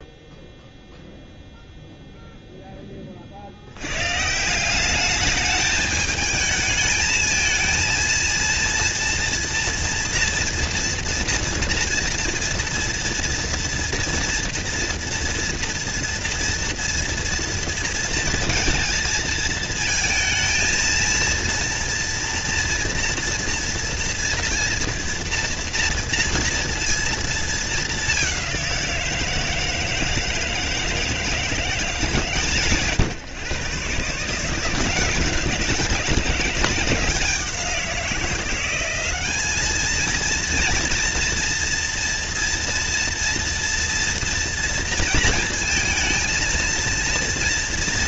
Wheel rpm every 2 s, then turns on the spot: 0, 20, 190, 220, 230, 230, 230, 230, 230, 230, 230, 230, 230, 230, 180, 160, 130, 170, 180, 190, 230, 230, 230, 230.
none